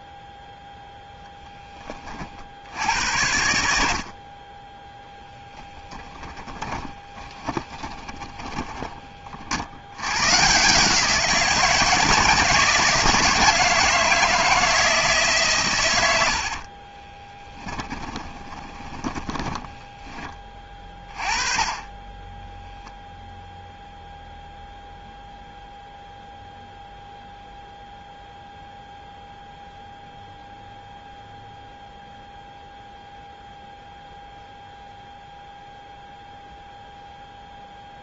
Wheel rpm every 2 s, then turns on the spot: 0, 60, 20, 10, 20, 140, 160, 160, 50, 20, 20, 0, 0, 0, 0, 0, 0, 0, 0.
6-10 16-20